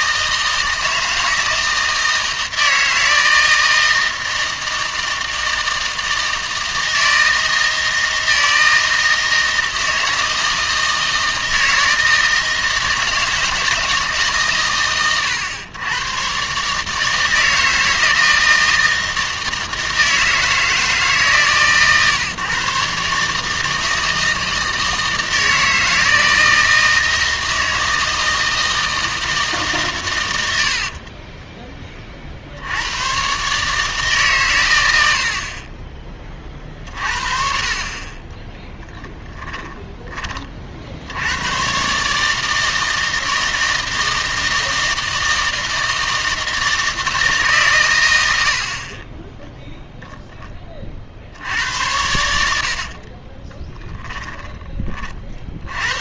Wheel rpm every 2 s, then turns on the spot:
160, 160, 160, 160, 160, 160, 160, 130, 140, 160, 160, 140, 160, 160, 160, 70, 90, 120, 40, 10, 50, 160, 160, 160, 60, 20, 70, 30.
38-40 52-54